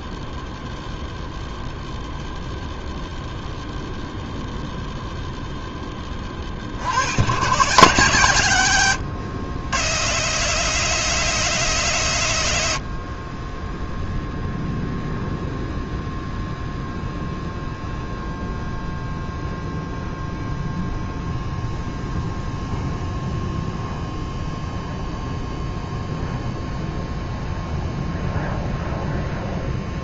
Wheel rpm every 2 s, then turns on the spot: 0, 0, 0, 50, 110, 160, 90, 0, 0, 0, 0, 0, 0, 0, 0.
none